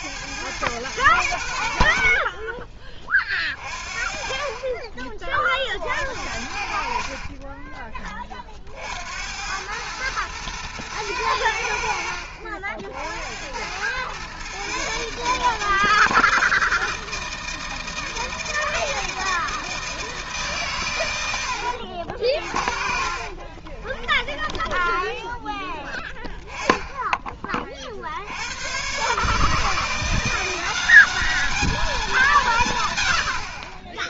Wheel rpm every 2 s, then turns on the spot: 100, 20, 30, 60, 60, 120, 70, 140, 160, 160, 130, 50, 10, 10, 120, 190, 130.
22-26